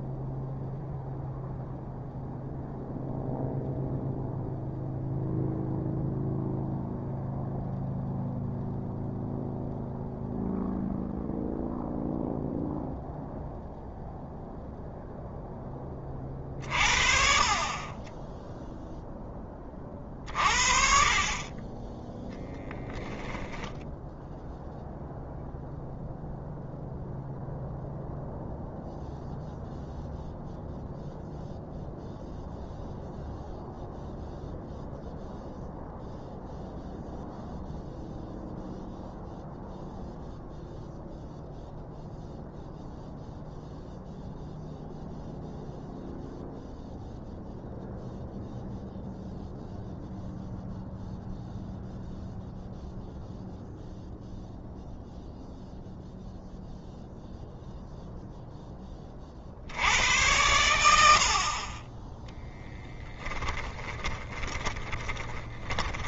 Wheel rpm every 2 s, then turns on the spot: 0, 0, 0, 0, 0, 0, 0, 0, 40, 0, 40, 10, 0, 0, 0, 0, 0, 0, 0, 0, 0, 0, 0, 0, 0, 0, 0, 0, 0, 20, 90, 10, 30.
22-24 62-66